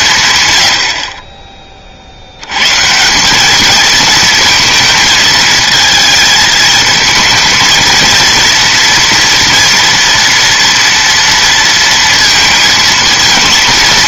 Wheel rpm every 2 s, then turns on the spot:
100, 130, 220, 220, 230, 230, 230.
none